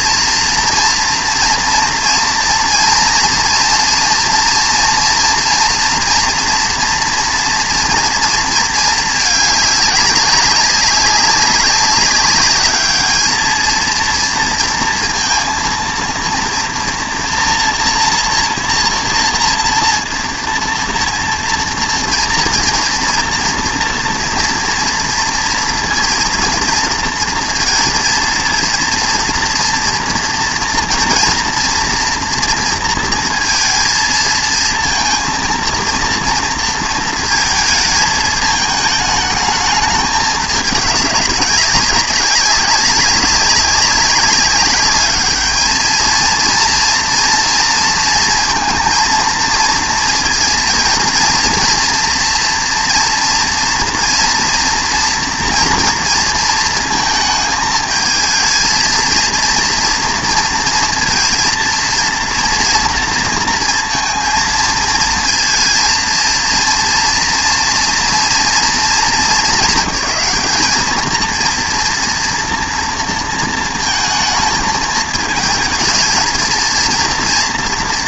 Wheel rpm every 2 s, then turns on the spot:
230, 230, 230, 230, 220, 200, 210, 230, 230, 230, 230, 230, 230, 230, 230, 230, 230, 230, 230, 210, 200, 200, 200, 230, 230, 230, 230, 230, 230, 220, 230, 230, 220, 230, 230, 210, 230, 220, 230.
none